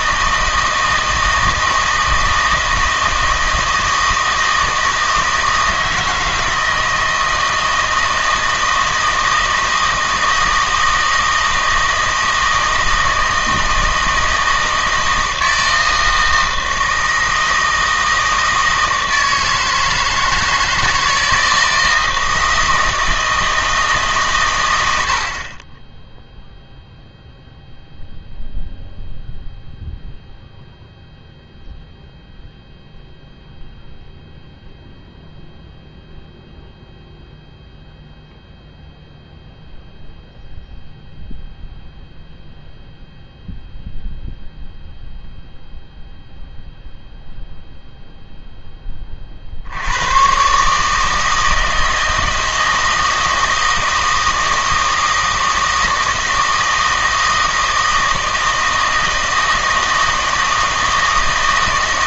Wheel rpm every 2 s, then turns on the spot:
160, 160, 160, 160, 160, 160, 160, 160, 160, 160, 160, 160, 90, 0, 0, 0, 0, 0, 0, 0, 0, 0, 0, 0, 10, 140, 160, 160, 160, 160, 160.
none